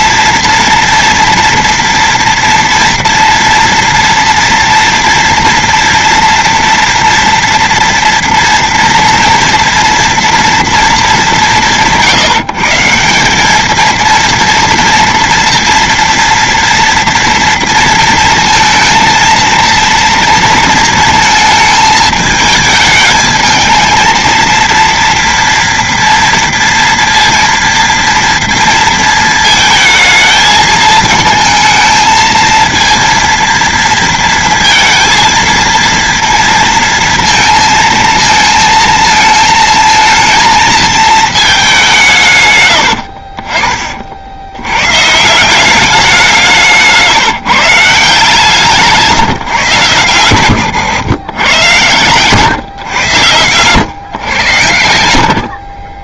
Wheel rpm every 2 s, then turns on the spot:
230, 230, 230, 230, 230, 230, 160, 230, 230, 230, 230, 220, 220, 230, 230, 220, 230, 230, 230, 230, 220, 170, 50, 180, 160, 120, 120, 110.
none